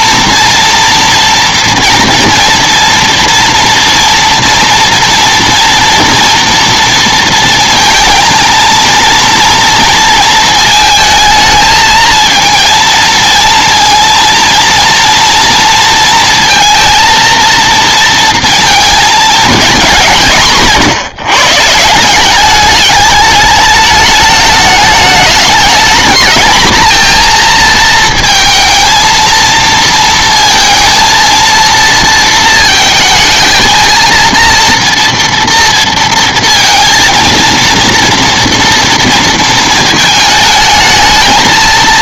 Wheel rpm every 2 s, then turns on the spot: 230, 230, 230, 230, 230, 220, 230, 230, 230, 230, 150, 200, 210, 220, 230, 230, 230, 230, 230, 230, 220.
none